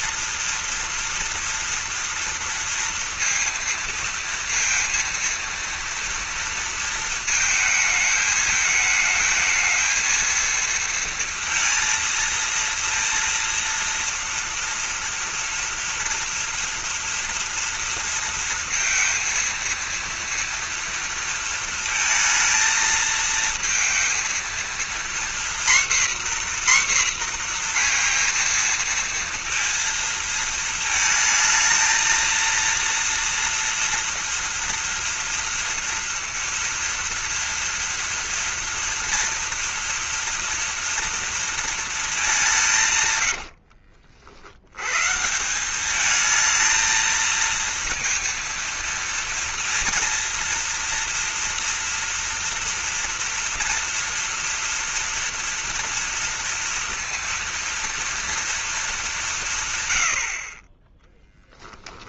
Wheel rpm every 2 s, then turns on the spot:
230, 230, 230, 230, 210, 230, 230, 230, 230, 230, 230, 230, 230, 250, 230, 230, 230, 230, 230, 240, 230, 150, 100, 220, 230, 230, 230, 240, 230, 220, 20.
none